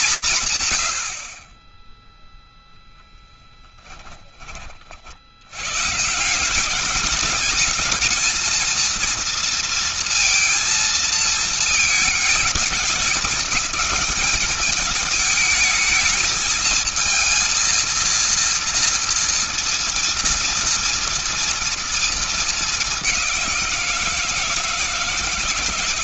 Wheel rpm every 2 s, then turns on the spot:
60, 0, 40, 190, 230, 230, 200, 210, 220, 230, 230, 220, 160.
none